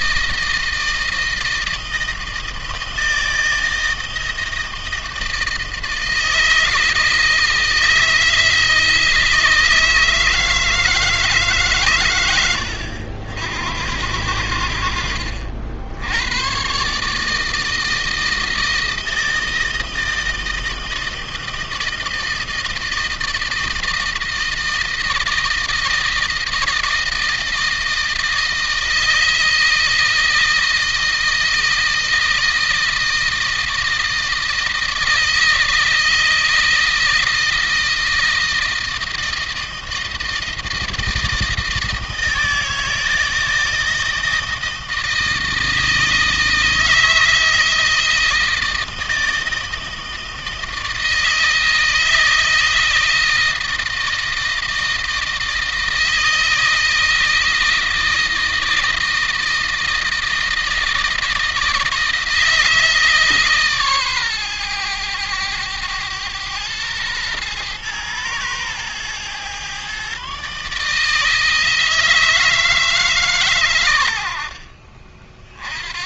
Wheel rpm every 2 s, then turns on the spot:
160, 160, 160, 160, 160, 160, 80, 80, 120, 160, 160, 160, 160, 160, 160, 160, 160, 160, 160, 160, 160, 160, 160, 160, 160, 160, 160, 160, 160, 160, 160, 160, 110, 110, 120, 140, 160, 50.
none